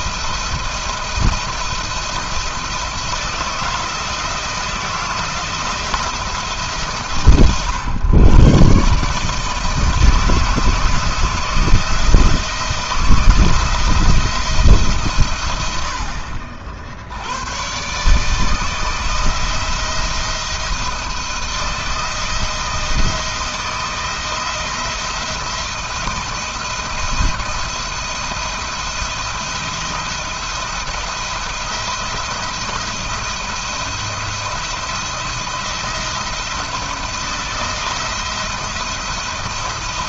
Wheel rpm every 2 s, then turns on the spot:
170, 160, 160, 150, 150, 160, 160, 140, 70, 160, 160, 160, 160, 170, 170, 170, 170, 170, 170, 170.
none